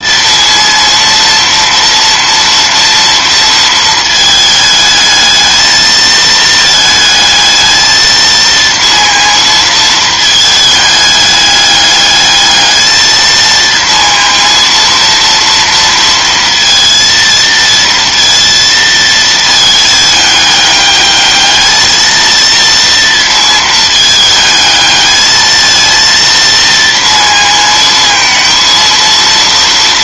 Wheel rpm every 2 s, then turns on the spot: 230, 230, 220, 220, 230, 210, 220, 230, 230, 230, 210, 230, 220, 230, 230.
none